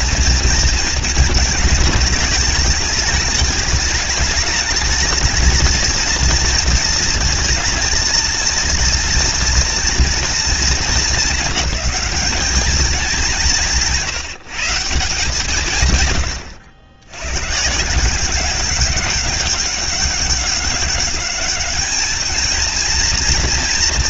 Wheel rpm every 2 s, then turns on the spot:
230, 210, 210, 230, 230, 220, 200, 160, 100, 190, 190, 220.
16-18